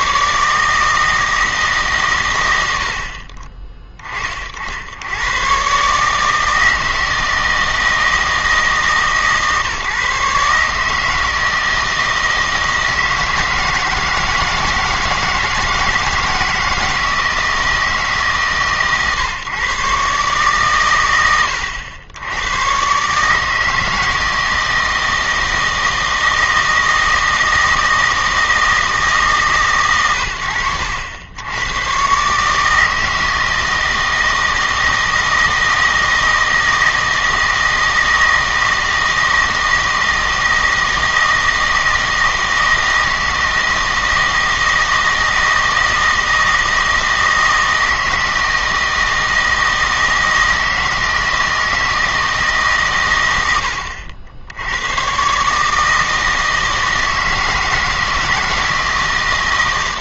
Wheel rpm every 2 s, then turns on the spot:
150, 90, 70, 160, 160, 150, 160, 160, 160, 130, 130, 110, 160, 160, 160, 80, 150, 160, 160, 160, 160, 160, 160, 160, 160, 160, 140, 90, 160, 160.
none